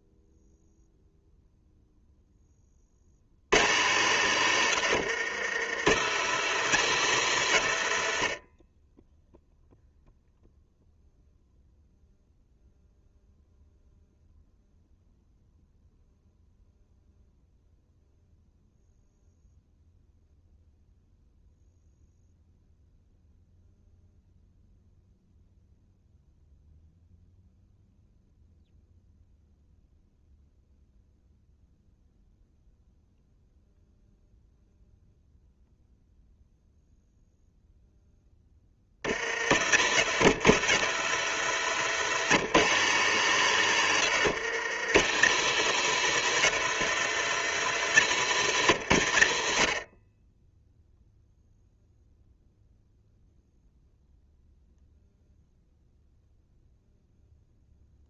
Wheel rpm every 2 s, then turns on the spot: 0, 30, 70, 100, 10, 0, 0, 0, 0, 0, 0, 0, 0, 0, 0, 0, 0, 0, 0, 30, 80, 90, 90, 100, 90, 0, 0, 0, 0.
none